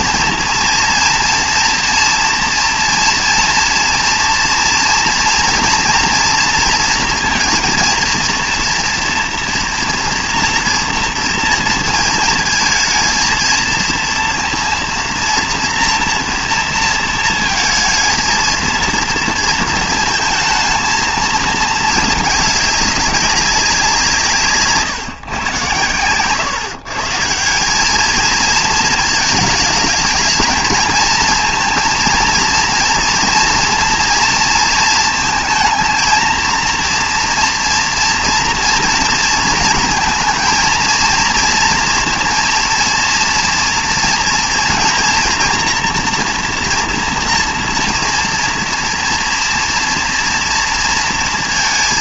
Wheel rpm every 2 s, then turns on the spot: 230, 230, 230, 230, 230, 230, 230, 230, 230, 230, 220, 210, 160, 130, 220, 220, 230, 230, 230, 240, 230, 230, 230, 240, 230, 230.
24-26